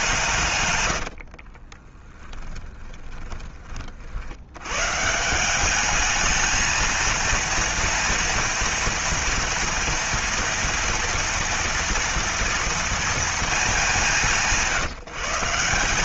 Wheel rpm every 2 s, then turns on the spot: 90, 10, 130, 220, 230, 230, 230, 160.
0-4